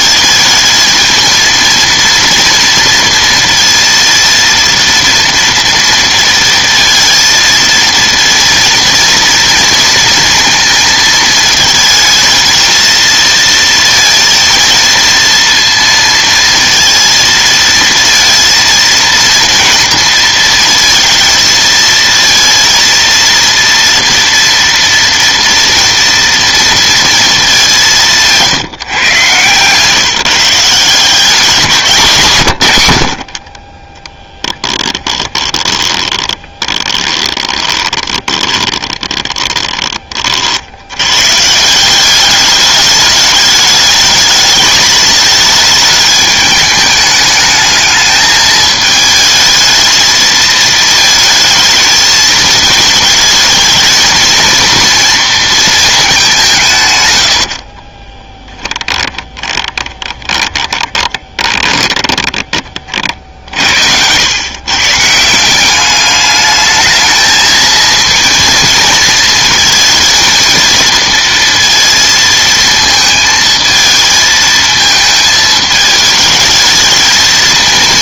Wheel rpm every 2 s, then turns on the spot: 220, 230, 230, 230, 230, 230, 230, 230, 230, 230, 230, 230, 240, 230, 140, 160, 80, 10, 20, 20, 80, 210, 210, 210, 220, 220, 220, 230, 150, 10, 30, 40, 130, 220, 230, 230, 220, 220, 220.
34-40 58-62